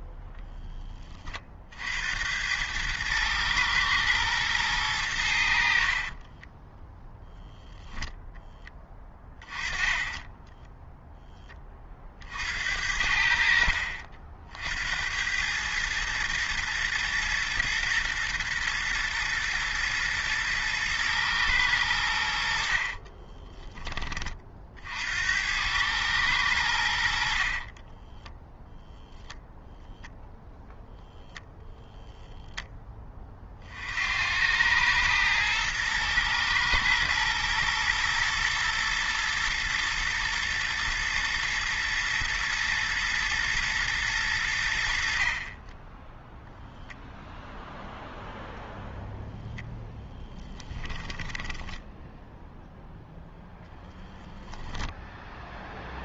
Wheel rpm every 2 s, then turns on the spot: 20, 110, 110, 10, 10, 0, 70, 70, 110, 120, 110, 50, 60, 80, 0, 0, 10, 100, 110, 120, 120, 110, 60, 0, 0, 10, 0, 0.
8-10 22-24 50-52